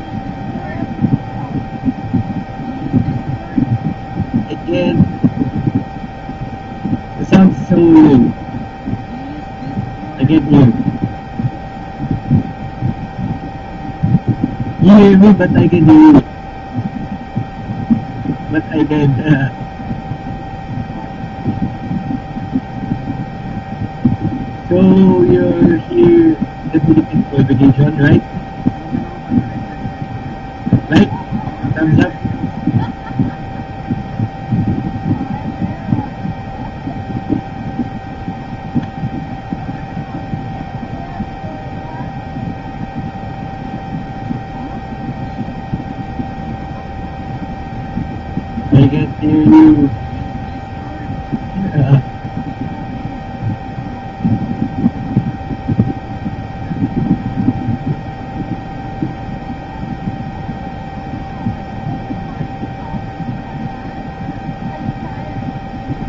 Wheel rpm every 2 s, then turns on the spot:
0, 0, 0, 0, 0, 0, 0, 0, 0, 0, 0, 0, 0, 0, 0, 0, 0, 0, 0, 0, 0, 0, 0, 0, 0, 0, 0, 0, 0, 0, 0, 0, 0.
none